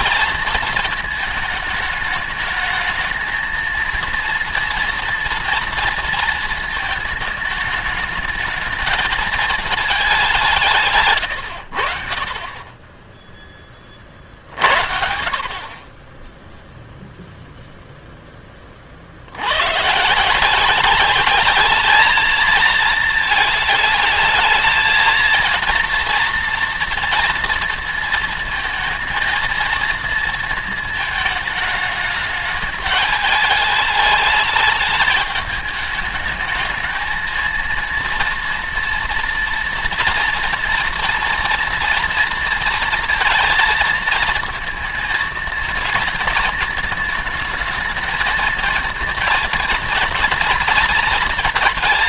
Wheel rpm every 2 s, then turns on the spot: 230, 220, 230, 220, 210, 170, 30, 50, 0, 30, 180, 220, 220, 230, 220, 220, 210, 210, 220, 230, 240, 230, 230, 220, 220, 230.
none